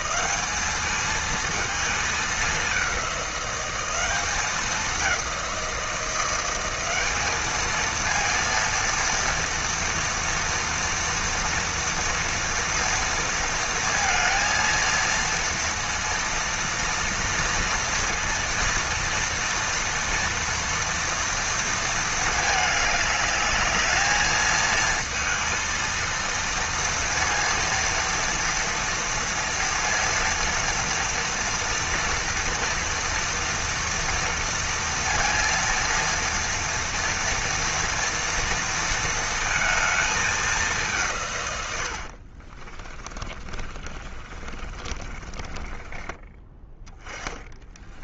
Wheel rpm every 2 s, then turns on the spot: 210, 200, 200, 190, 230, 230, 230, 230, 230, 230, 230, 210, 220, 230, 230, 230, 230, 230, 230, 230, 190, 30, 30, 10.
42-46